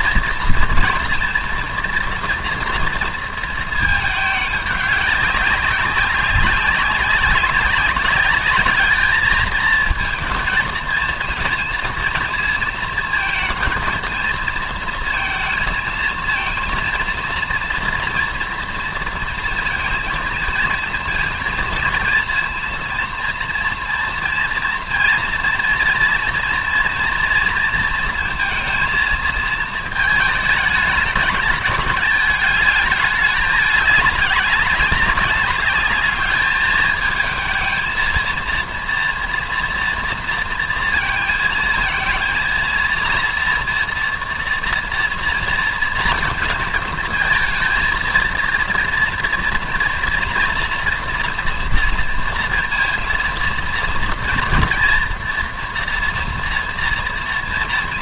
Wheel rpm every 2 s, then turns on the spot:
230, 240, 210, 200, 210, 220, 230, 230, 230, 230, 230, 230, 230, 230, 230, 220, 220, 200, 210, 230, 230, 230, 230, 230, 230, 240, 230, 230, 230.
none